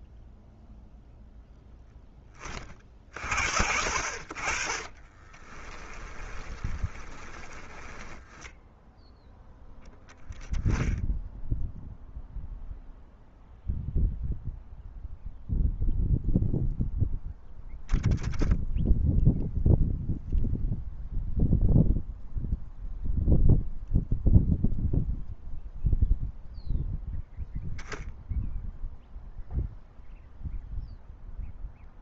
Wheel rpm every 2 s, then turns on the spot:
0, 40, 40, 20, 0, 0, 0, 0, 0, 0, 0, 0, 0, 0, 0, 0.
6-8